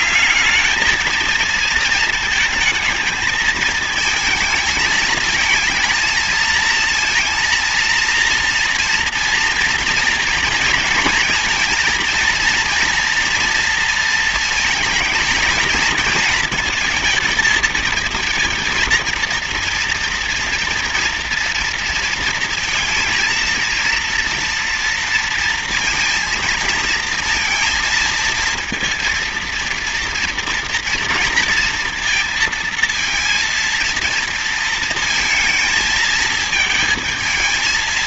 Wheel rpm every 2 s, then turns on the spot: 220, 220, 220, 230, 230, 230, 230, 220, 220, 230, 230, 230, 230, 230, 230, 230, 230, 230, 220.
none